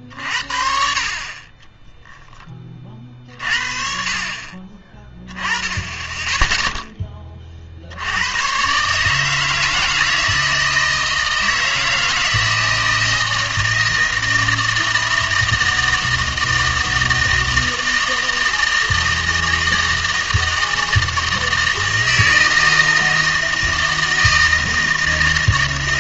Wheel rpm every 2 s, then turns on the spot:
60, 40, 20, 0, 130, 160, 160, 160, 160, 160, 160, 160, 160.
none